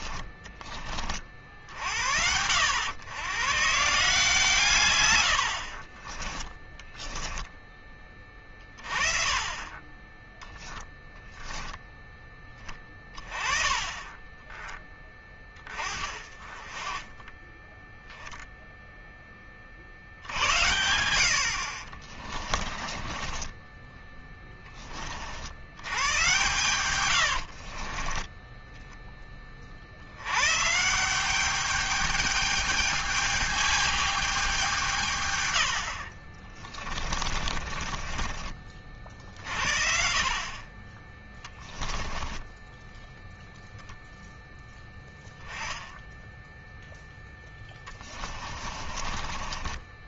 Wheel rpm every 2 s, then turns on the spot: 20, 70, 140, 20, 20, 20, 10, 20, 30, 0, 70, 30, 10, 110, 10, 110, 210, 200, 50, 30, 40, 10, 0, 10, 20.
6-8 22-24 26-30 36-40 42-44 48-50